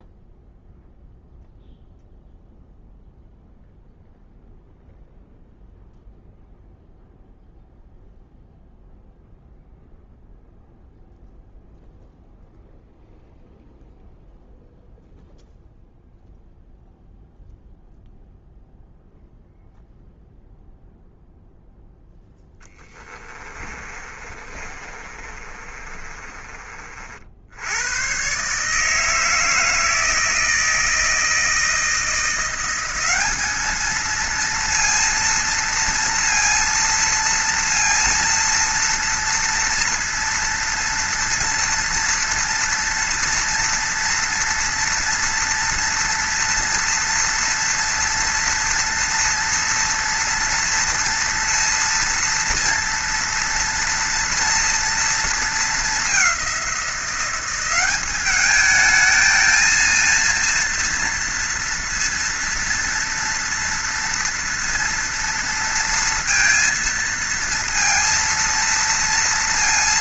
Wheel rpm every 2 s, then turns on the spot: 0, 0, 0, 0, 0, 0, 0, 0, 0, 0, 0, 10, 30, 30, 130, 160, 170, 230, 230, 230, 230, 240, 230, 230, 230, 230, 230, 230, 190, 210, 230, 230, 230, 230, 230.
22-26